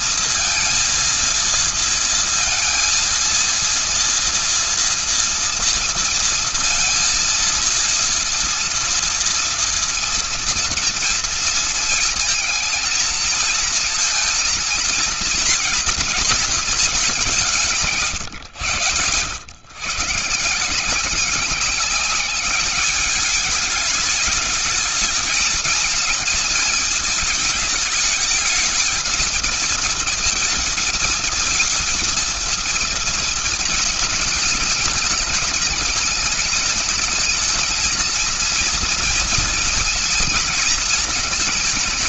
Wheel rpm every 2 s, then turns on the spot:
230, 230, 230, 230, 230, 230, 230, 230, 200, 130, 180, 210, 220, 220, 230, 230, 230, 220, 220, 230, 230.
none